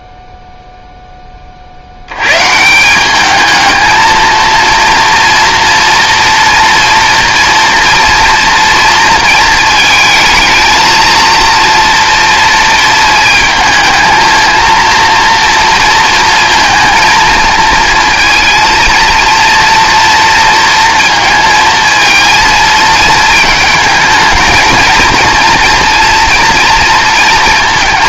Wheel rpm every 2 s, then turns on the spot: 0, 160, 230, 230, 230, 220, 230, 230, 230, 230, 230, 220, 220, 230.
none